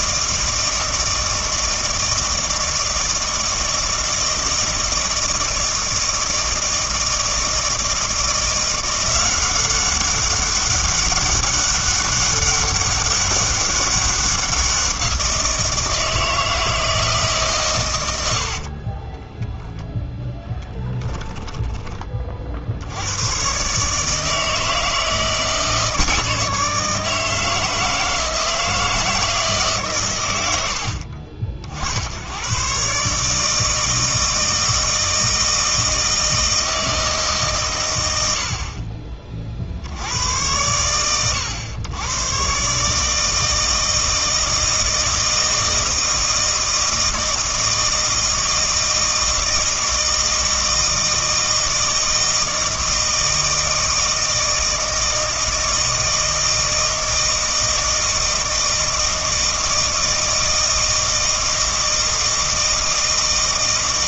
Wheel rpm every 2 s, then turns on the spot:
160, 160, 160, 160, 170, 200, 200, 180, 160, 60, 10, 50, 160, 160, 160, 90, 110, 160, 160, 60, 100, 130, 160, 160, 160, 160, 160, 160, 160, 160, 160, 160.
18-22